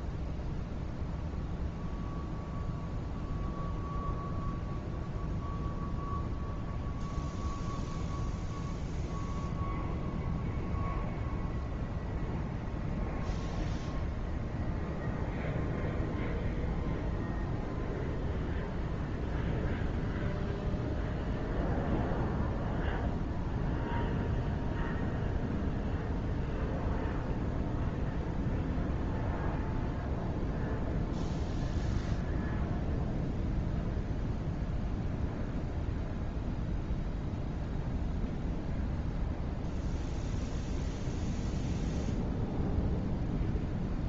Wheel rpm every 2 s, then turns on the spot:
0, 0, 0, 0, 0, 0, 0, 0, 0, 0, 0, 0, 0, 0, 0, 0, 0, 0, 0, 0, 0, 0.
none